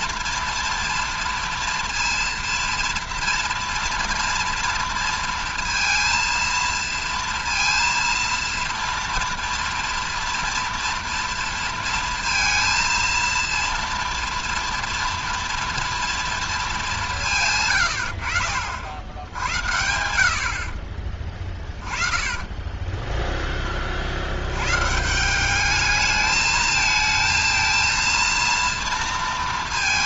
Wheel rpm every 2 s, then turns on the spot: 230, 230, 230, 230, 230, 230, 230, 230, 230, 70, 80, 20, 90, 220, 230.
22-24